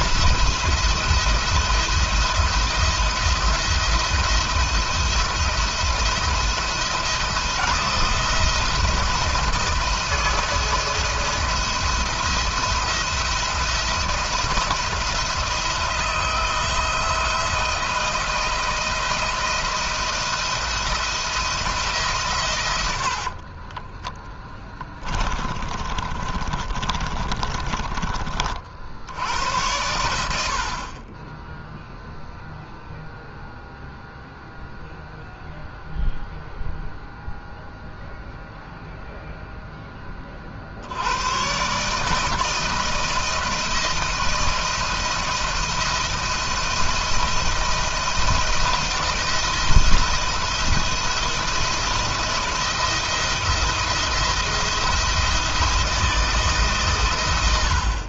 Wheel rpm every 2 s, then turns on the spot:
170, 170, 170, 170, 170, 170, 170, 170, 170, 160, 170, 90, 20, 20, 60, 40, 0, 0, 0, 0, 80, 160, 170, 170, 170, 170, 170, 170, 130.
22-28